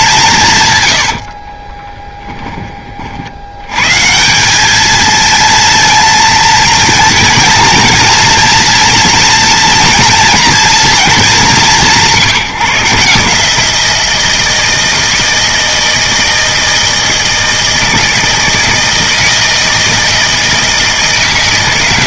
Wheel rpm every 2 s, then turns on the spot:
130, 20, 200, 220, 230, 230, 160, 160, 160, 160, 160.
none